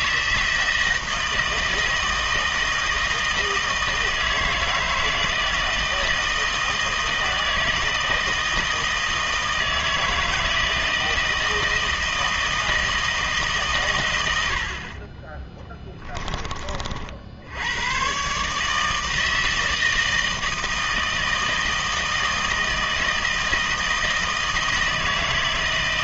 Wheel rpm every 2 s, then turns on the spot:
160, 160, 160, 160, 160, 160, 160, 60, 30, 150, 160, 160, 160.
none